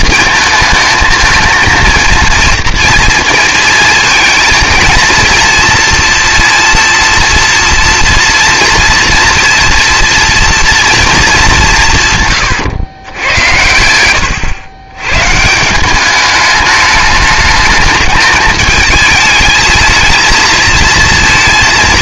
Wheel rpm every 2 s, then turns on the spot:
220, 230, 230, 230, 230, 230, 110, 100, 210, 220, 220.
none